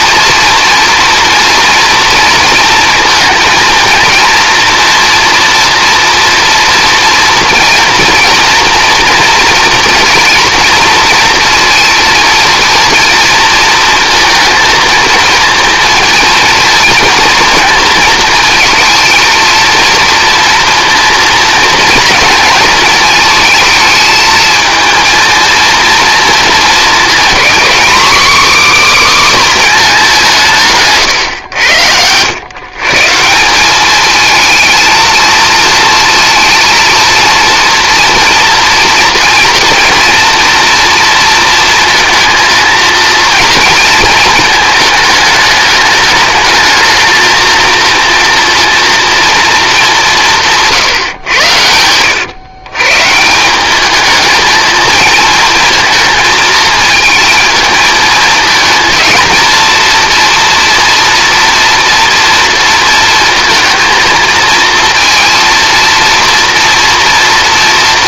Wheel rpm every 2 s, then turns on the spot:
230, 230, 230, 230, 230, 230, 230, 230, 230, 220, 230, 230, 220, 230, 280, 170, 120, 220, 230, 240, 240, 230, 220, 220, 230, 170, 110, 220, 220, 220, 230, 230, 230, 230.
none